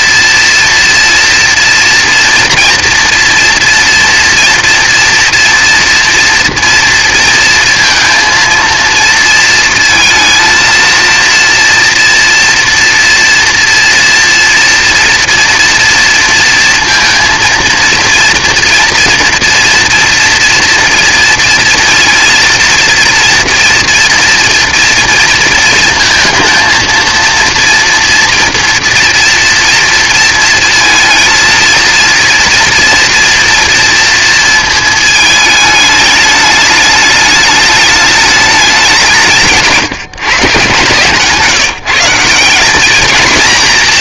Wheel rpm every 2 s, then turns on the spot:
230, 240, 230, 230, 230, 230, 230, 230, 230, 230, 230, 230, 230, 230, 230, 230, 240, 220, 210, 200, 150, 210.
none